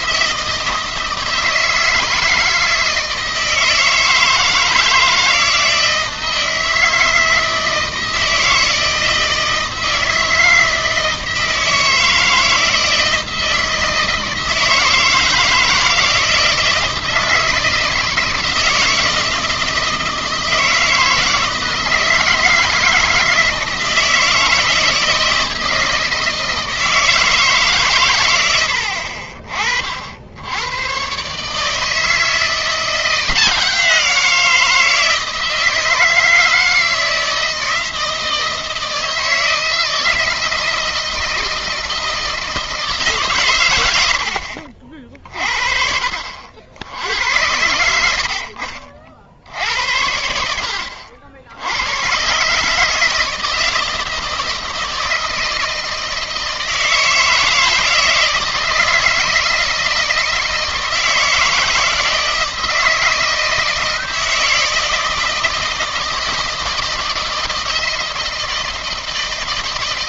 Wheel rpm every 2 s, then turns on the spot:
160, 160, 160, 160, 160, 160, 160, 160, 160, 160, 160, 160, 160, 160, 70, 110, 170, 160, 160, 160, 160, 160, 50, 80, 60, 70, 150, 160, 160, 160, 160, 160, 160, 160, 160.
none